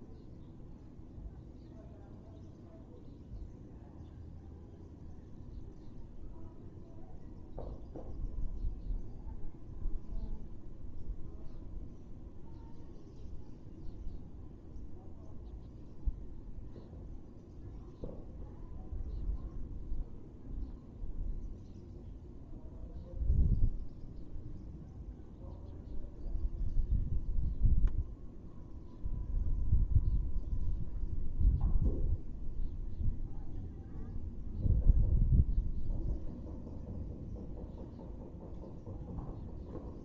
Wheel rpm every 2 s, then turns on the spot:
0, 0, 0, 0, 0, 0, 0, 0, 0, 0, 0, 0, 0, 0, 0, 0, 0, 0, 0, 0.
none